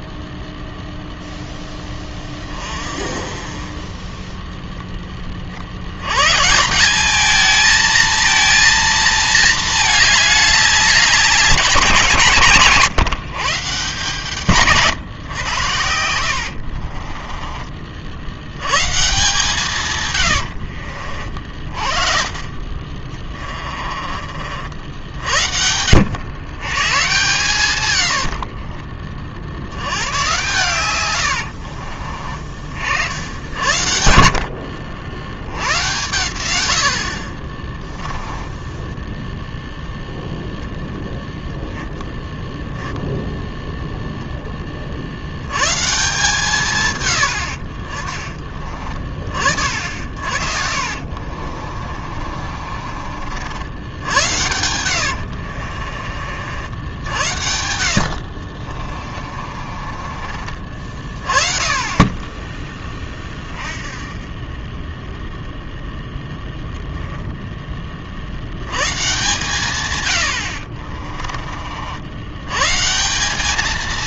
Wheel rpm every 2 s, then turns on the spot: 0, 30, 0, 170, 230, 200, 140, 140, 60, 110, 60, 40, 60, 110, 70, 120, 40, 60, 90, 10, 0, 10, 20, 150, 30, 50, 40, 90, 60, 50, 40, 10, 20, 10, 100, 70, 120.
16-18 20-22 28-30 38-40 50-56 58-60 70-72